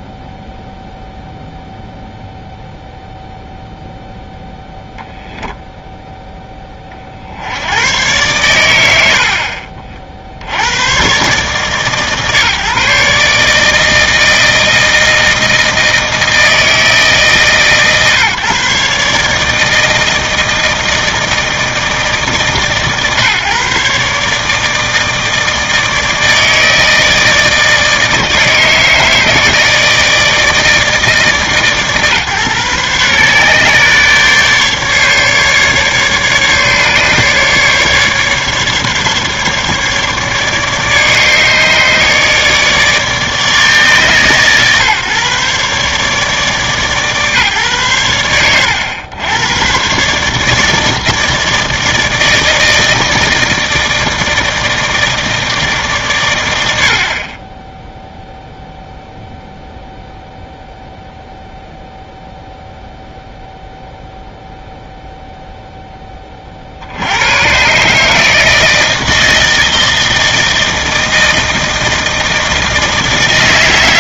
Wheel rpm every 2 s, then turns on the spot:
0, 0, 0, 110, 50, 150, 160, 160, 140, 160, 150, 150, 160, 160, 160, 140, 140, 140, 150, 150, 150, 150, 140, 100, 130, 160, 160, 120, 0, 0, 0, 0, 0, 80, 160, 160, 160.
none